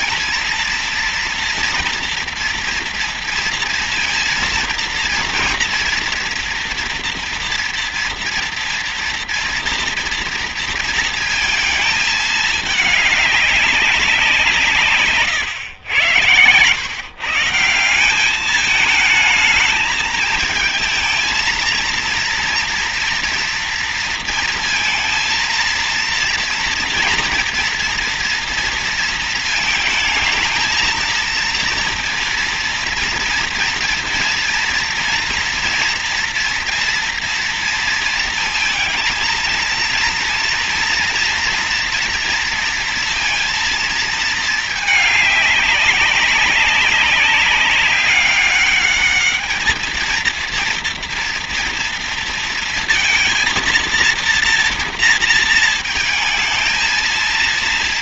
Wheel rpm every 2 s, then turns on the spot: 230, 230, 230, 240, 230, 230, 210, 150, 140, 220, 220, 230, 230, 230, 230, 230, 230, 230, 230, 220, 230, 230, 210, 200, 210, 230, 230, 230, 230.
14-16